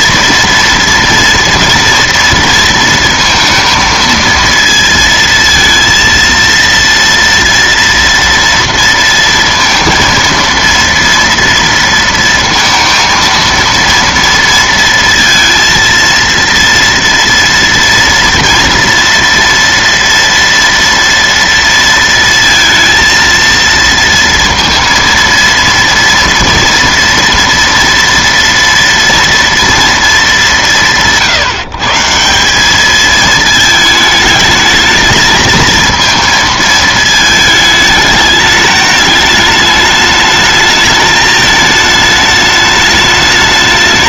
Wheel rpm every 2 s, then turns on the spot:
230, 230, 230, 230, 230, 230, 230, 230, 230, 230, 230, 230, 230, 230, 230, 180, 210, 220, 220, 210, 210, 210.
none